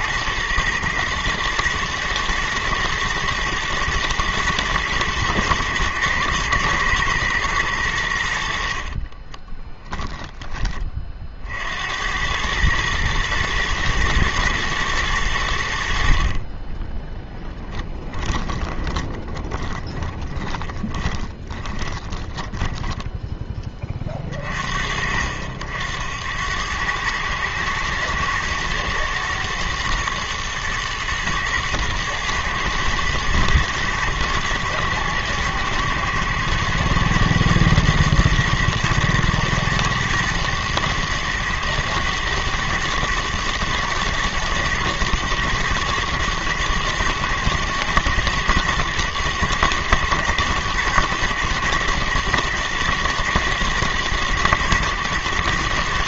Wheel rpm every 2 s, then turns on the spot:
120, 110, 110, 110, 60, 30, 110, 110, 20, 20, 20, 10, 50, 100, 120, 110, 110, 120, 120, 110, 110, 120, 110, 110, 120, 120, 110, 120.
8-10 18-24